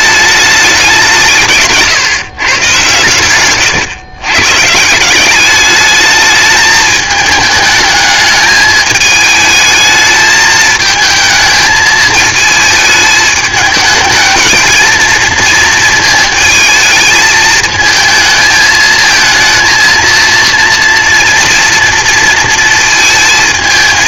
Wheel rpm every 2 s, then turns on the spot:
190, 130, 150, 210, 210, 220, 220, 220, 220, 220, 230, 230.
none